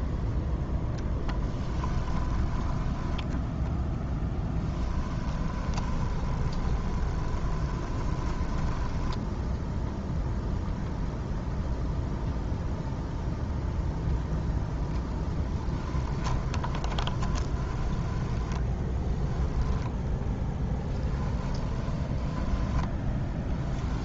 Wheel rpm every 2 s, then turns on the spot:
10, 10, 10, 20, 10, 0, 0, 10, 20, 10, 10, 10.
0-10 16-24